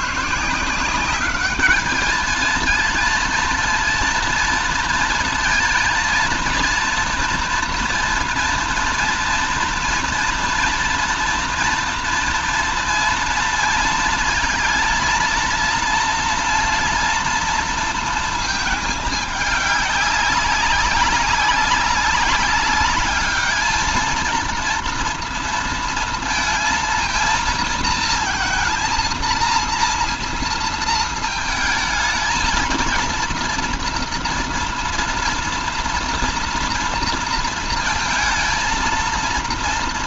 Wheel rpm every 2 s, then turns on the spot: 150, 220, 230, 230, 230, 230, 230, 230, 230, 220, 200, 200, 230, 230, 230, 230, 220, 240, 230, 230.
none